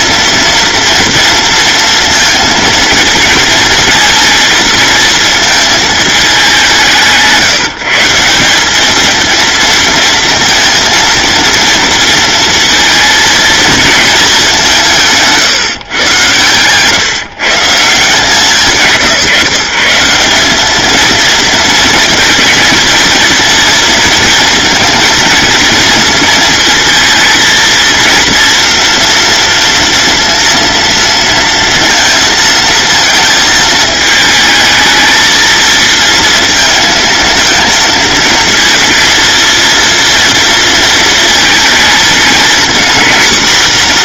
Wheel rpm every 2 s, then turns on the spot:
230, 230, 230, 170, 220, 230, 230, 170, 130, 170, 210, 230, 230, 230, 230, 230, 230, 220, 230, 230, 230, 230.
none